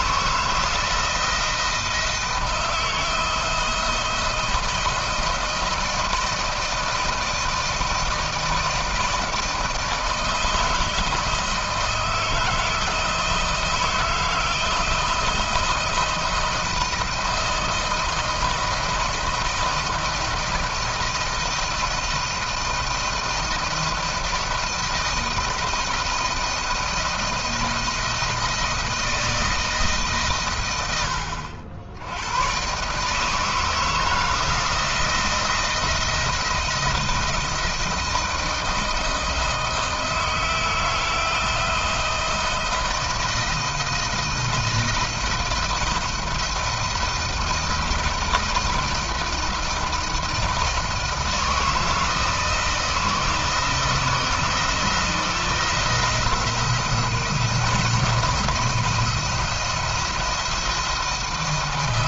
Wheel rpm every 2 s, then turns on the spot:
160, 160, 160, 160, 160, 160, 160, 160, 160, 170, 170, 160, 160, 160, 160, 120, 120, 160, 170, 160, 160, 160, 160, 170, 160, 160, 160, 160, 170, 160, 170.
none